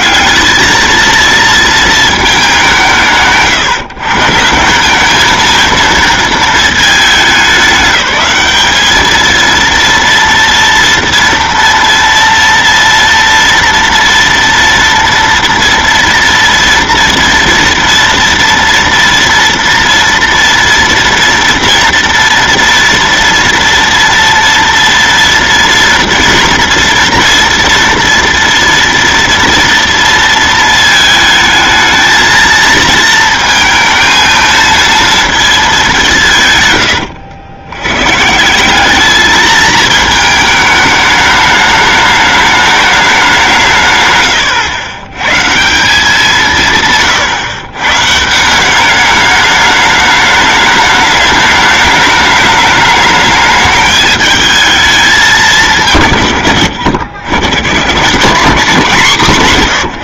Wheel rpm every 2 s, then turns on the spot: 210, 190, 180, 220, 200, 230, 230, 230, 230, 230, 230, 230, 230, 230, 230, 220, 220, 230, 130, 180, 220, 210, 100, 150, 180, 210, 210, 210, 100, 170.
none